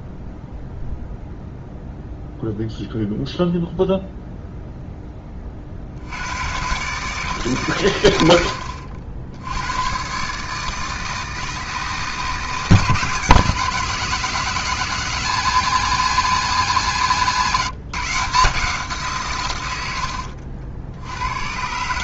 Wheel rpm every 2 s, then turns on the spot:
0, 0, 0, 120, 70, 150, 170, 190, 170, 170, 70.
8-10